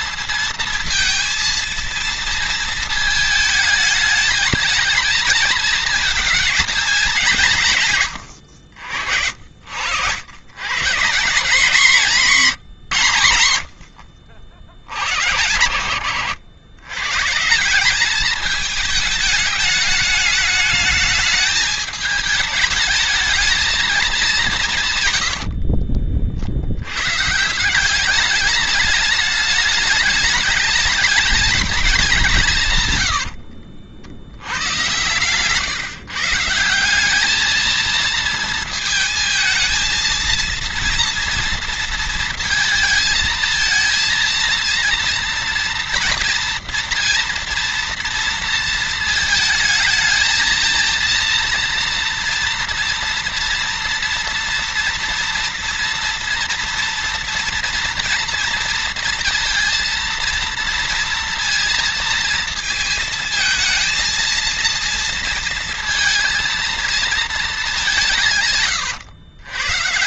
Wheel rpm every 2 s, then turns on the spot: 230, 220, 220, 210, 90, 120, 170, 70, 110, 210, 210, 220, 180, 70, 210, 210, 160, 90, 170, 220, 230, 230, 230, 230, 230, 220, 230, 230, 230, 230, 230, 230, 230, 230, 130.
none